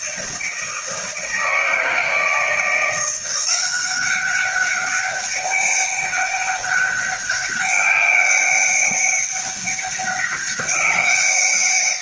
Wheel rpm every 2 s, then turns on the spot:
160, 170, 200, 200, 200, 190.
none